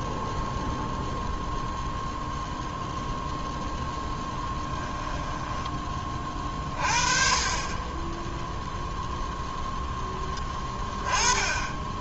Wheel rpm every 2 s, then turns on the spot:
0, 0, 10, 30, 0, 20.
4-6